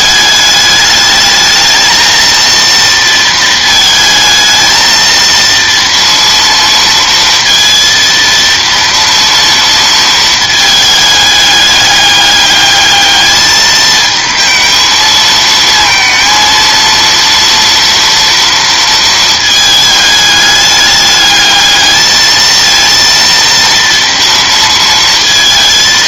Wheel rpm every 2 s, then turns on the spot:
210, 230, 220, 230, 230, 220, 210, 220, 230, 230, 210, 220, 230.
none